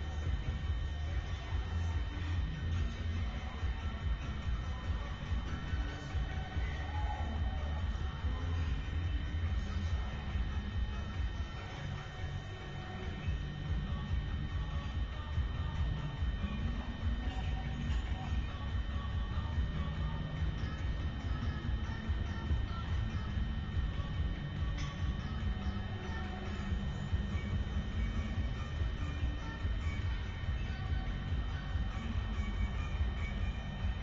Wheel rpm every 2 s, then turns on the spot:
0, 0, 0, 0, 0, 0, 0, 0, 0, 0, 0, 0, 0, 0, 0, 0, 0.
none